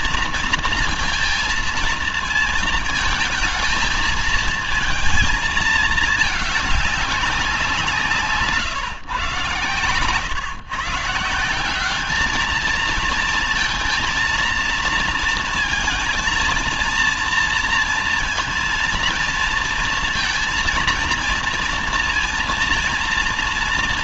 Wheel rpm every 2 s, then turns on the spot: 230, 220, 230, 200, 140, 140, 220, 230, 230, 230, 230, 230.
none